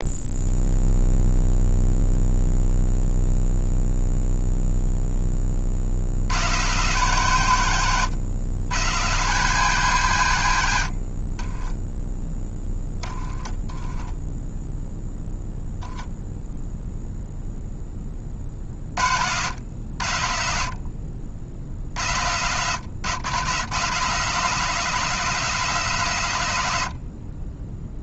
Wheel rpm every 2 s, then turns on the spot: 0, 0, 10, 140, 130, 60, 10, 0, 0, 60, 60, 130, 180, 70.
12-14